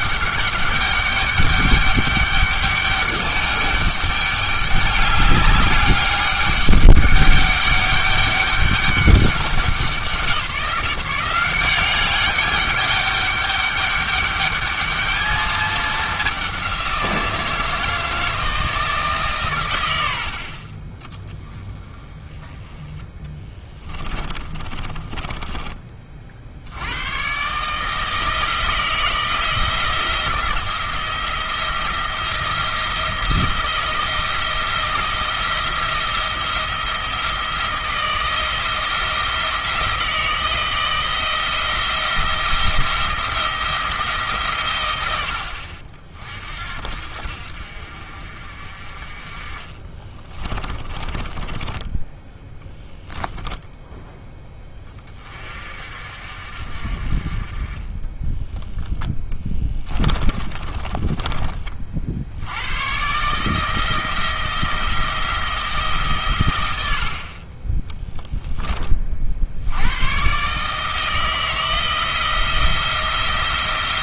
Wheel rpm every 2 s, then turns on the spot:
200, 200, 200, 200, 200, 160, 200, 210, 190, 160, 30, 10, 20, 80, 160, 170, 170, 170, 170, 170, 160, 170, 120, 60, 40, 20, 10, 20, 60, 20, 30, 100, 170, 90, 20, 150, 170.
24-26 50-52 58-62